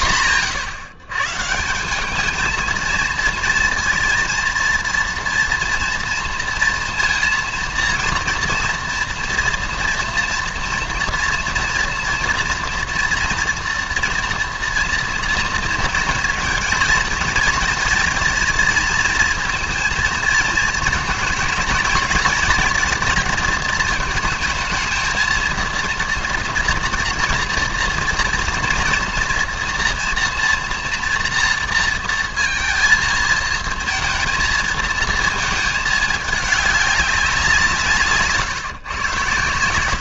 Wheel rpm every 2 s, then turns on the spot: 130, 220, 230, 230, 230, 230, 230, 230, 230, 230, 230, 220, 220, 230, 230, 230, 230, 230, 210, 140.
none